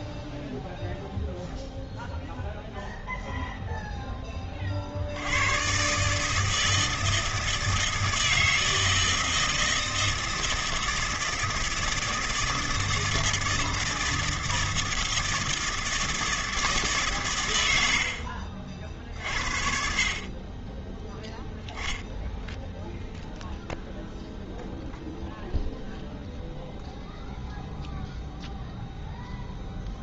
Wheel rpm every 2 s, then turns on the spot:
0, 0, 60, 160, 160, 160, 160, 160, 140, 60, 10, 0, 0, 0, 0.
none